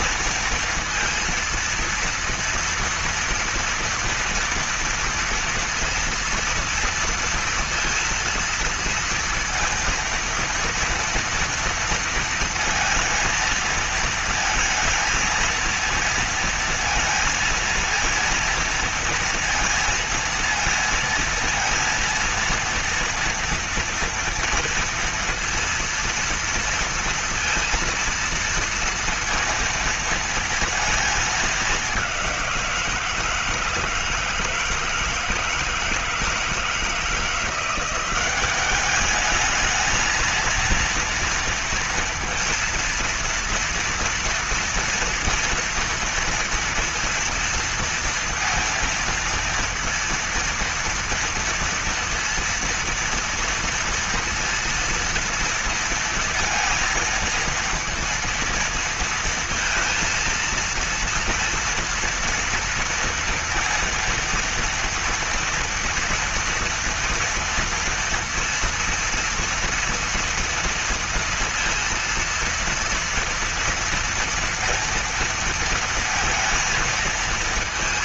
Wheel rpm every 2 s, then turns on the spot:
230, 230, 230, 230, 230, 230, 230, 220, 230, 230, 230, 230, 230, 230, 230, 220, 170, 160, 170, 210, 230, 230, 230, 230, 230, 230, 230, 230, 230, 230, 230, 230, 230, 230, 230, 230, 230, 230, 230.
none